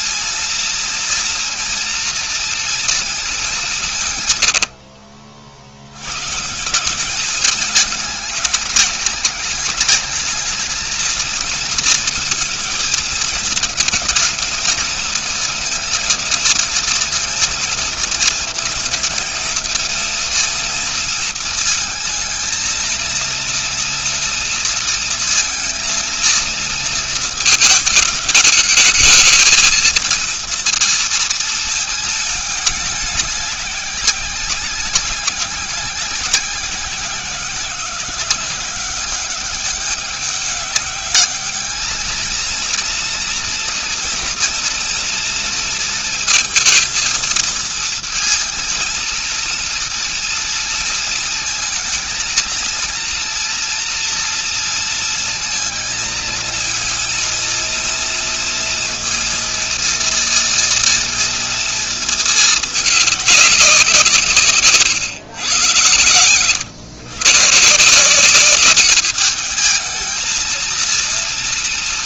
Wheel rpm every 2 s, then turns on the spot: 230, 230, 130, 150, 220, 220, 230, 230, 230, 220, 230, 220, 230, 230, 210, 230, 210, 190, 190, 190, 200, 230, 230, 230, 230, 230, 230, 230, 230, 230, 230, 220, 160, 120, 200, 220.
none